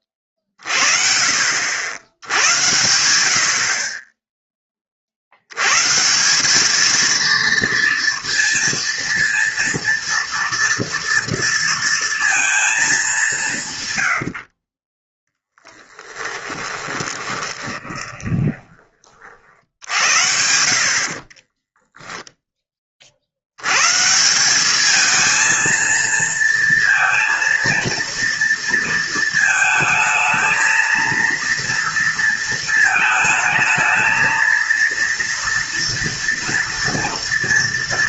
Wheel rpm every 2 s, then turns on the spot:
30, 90, 20, 200, 230, 230, 220, 40, 20, 20, 70, 20, 200, 230, 230, 230, 230, 230, 230.
16-20